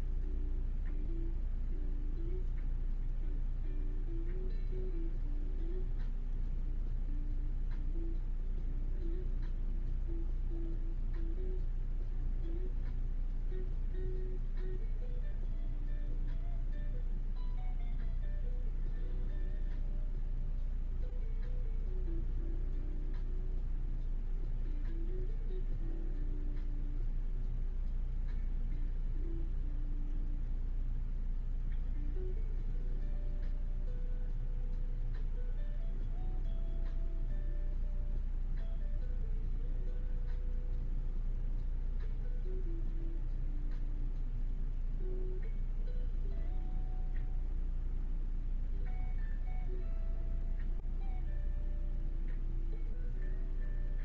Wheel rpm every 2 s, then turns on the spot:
0, 0, 0, 0, 0, 0, 0, 0, 0, 0, 0, 0, 0, 0, 0, 0, 0, 0, 0, 0, 0, 0, 0, 0, 0, 0, 0.
none